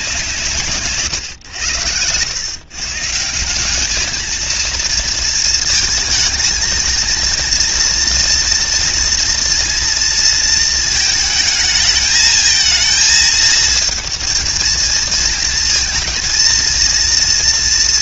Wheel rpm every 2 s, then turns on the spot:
150, 130, 230, 230, 240, 230, 220, 230, 230.
0-2